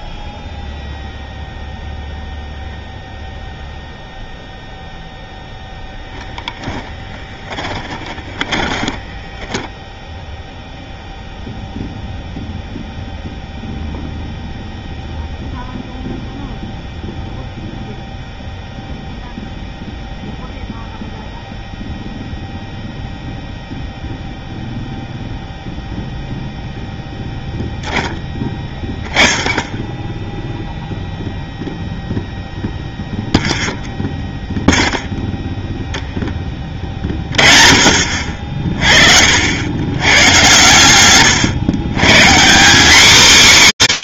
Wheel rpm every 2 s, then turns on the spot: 0, 0, 0, 10, 20, 0, 0, 0, 0, 0, 0, 0, 0, 0, 10, 0, 0, 0, 10, 50, 110, 200.
6-10 36-38